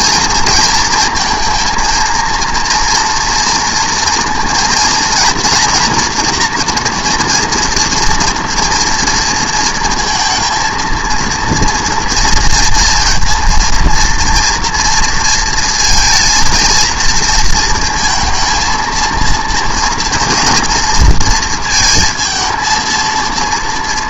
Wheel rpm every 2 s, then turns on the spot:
230, 230, 230, 240, 230, 230, 230, 230, 230, 220, 230, 230.
none